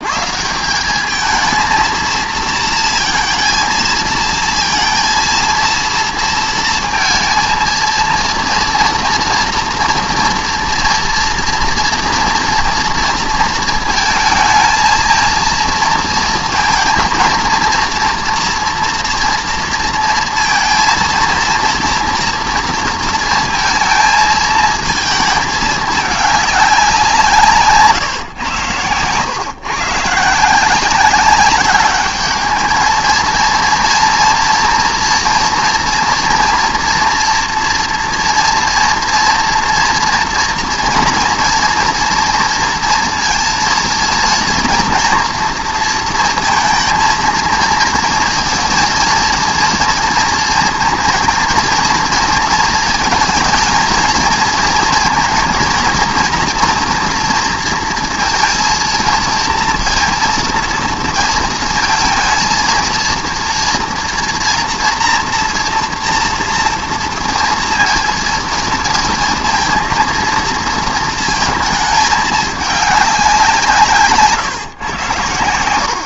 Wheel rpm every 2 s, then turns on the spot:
180, 230, 230, 230, 230, 230, 230, 230, 220, 230, 230, 230, 220, 190, 110, 180, 220, 230, 230, 230, 230, 230, 230, 230, 230, 230, 220, 230, 240, 230, 230, 230, 240, 230, 230, 230, 210, 130.
none